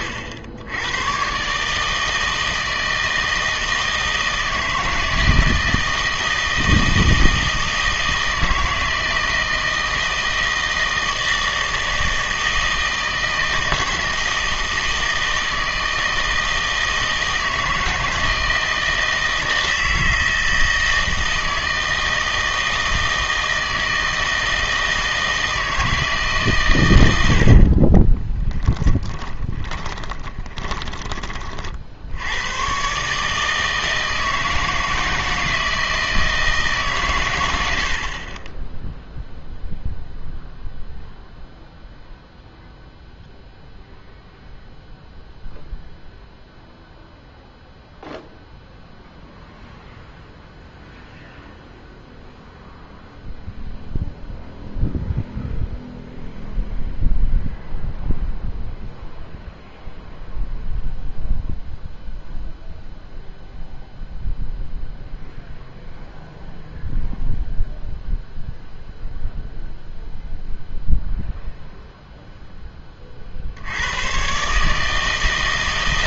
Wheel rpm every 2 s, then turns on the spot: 80, 160, 160, 160, 160, 160, 160, 160, 160, 160, 160, 160, 160, 120, 10, 30, 120, 160, 150, 10, 0, 0, 0, 0, 0, 0, 0, 0, 0, 0, 0, 0, 0, 0, 0, 0, 10, 150.
28-32